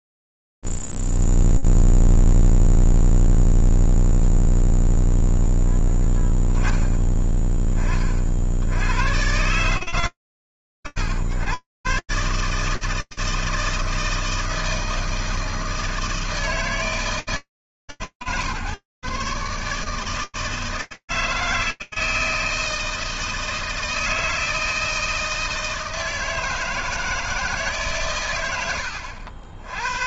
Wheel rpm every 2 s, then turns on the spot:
0, 0, 0, 10, 80, 110, 160, 160, 160, 150, 160, 160, 160, 160, 90.
none